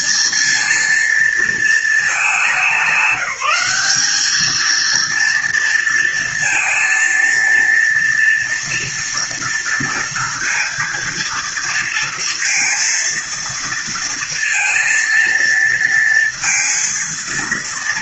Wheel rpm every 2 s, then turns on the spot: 230, 190, 230, 230, 230, 230, 230, 230, 230.
none